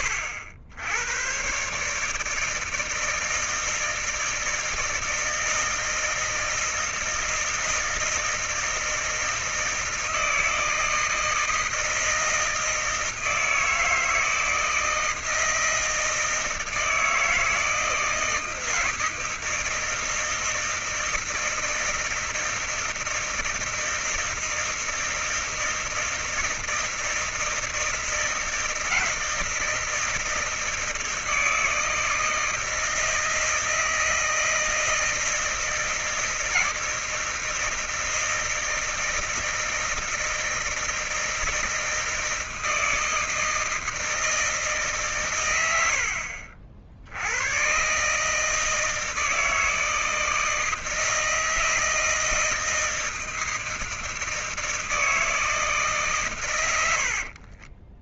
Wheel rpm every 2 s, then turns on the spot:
100, 160, 160, 160, 160, 160, 160, 160, 160, 160, 160, 160, 160, 160, 160, 160, 160, 160, 160, 160, 160, 160, 150, 70, 150, 160, 160, 160, 110.
56-58